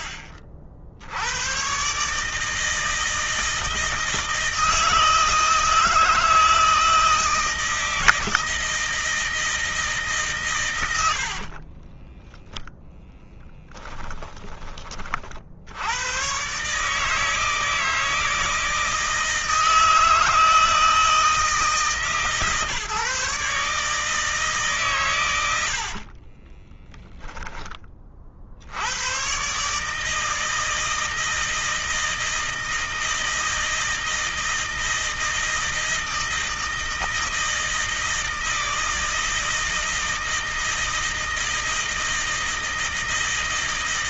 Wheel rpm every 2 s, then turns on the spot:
50, 160, 160, 160, 160, 100, 10, 30, 150, 160, 160, 140, 140, 10, 80, 160, 160, 160, 160, 160, 160, 160.
10-14 26-28